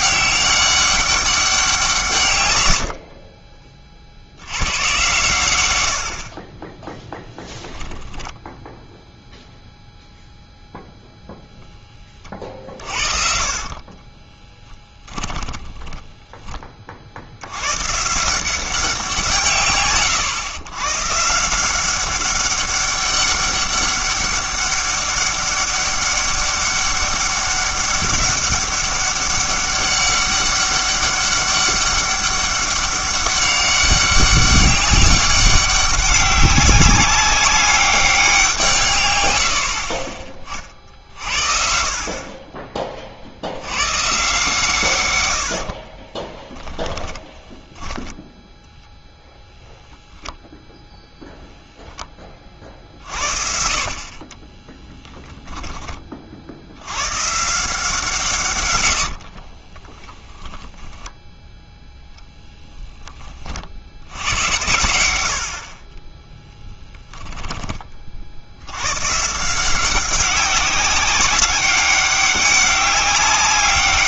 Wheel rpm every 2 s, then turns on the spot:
200, 100, 100, 20, 0, 0, 50, 20, 30, 180, 120, 200, 200, 200, 200, 200, 200, 200, 190, 160, 40, 30, 130, 10, 0, 0, 40, 10, 80, 120, 30, 10, 100, 10, 90, 190, 200.
12-16 46-48 54-56 60-62